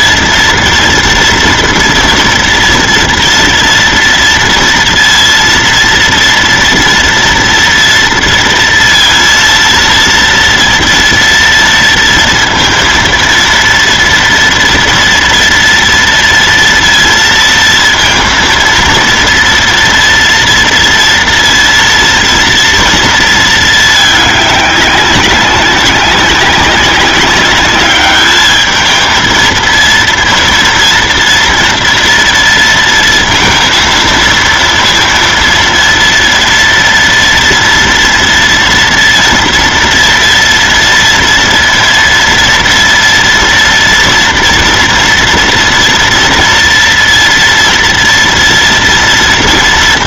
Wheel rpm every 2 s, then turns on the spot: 230, 230, 230, 230, 230, 230, 230, 230, 230, 230, 230, 230, 200, 190, 220, 230, 230, 230, 230, 230, 230, 230, 230, 230, 230.
none